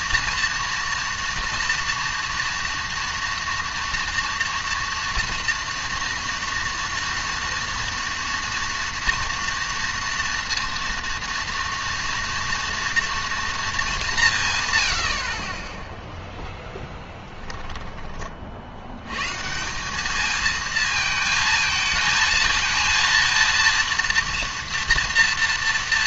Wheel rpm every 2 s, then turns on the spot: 230, 230, 230, 230, 230, 230, 230, 110, 10, 50, 220, 230, 230.
none